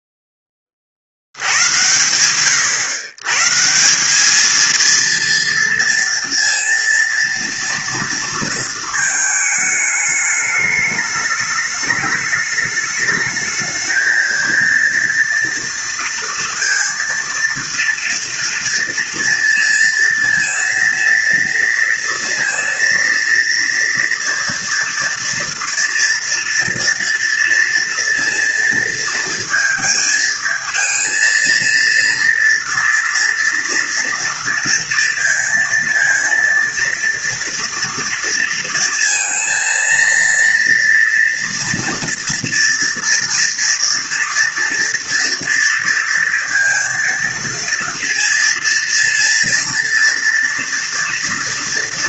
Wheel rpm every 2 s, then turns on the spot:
40, 120, 230, 230, 230, 210, 210, 230, 230, 230, 230, 230, 230, 230, 230, 220, 230, 230, 230, 230, 230, 230, 230, 230, 230, 230.
none